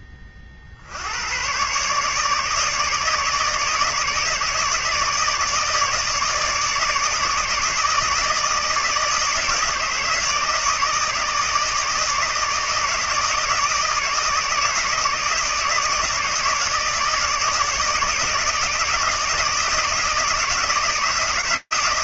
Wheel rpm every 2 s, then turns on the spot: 40, 150, 160, 160, 160, 160, 160, 160, 160, 160, 160.
none